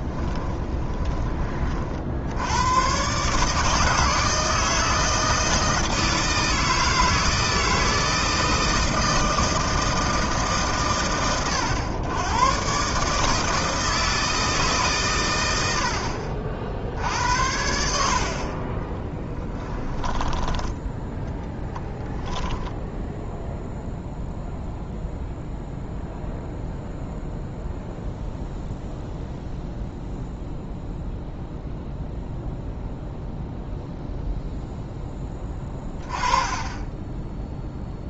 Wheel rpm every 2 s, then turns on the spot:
20, 110, 160, 160, 160, 100, 130, 140, 60, 20, 20, 0, 0, 0, 0, 0, 0, 0, 10.
0-2 18-20